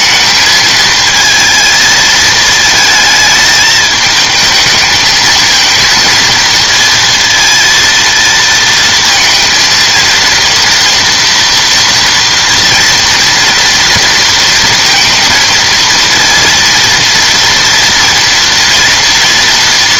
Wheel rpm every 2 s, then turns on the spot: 220, 220, 220, 230, 220, 230, 230, 230, 230, 230.
none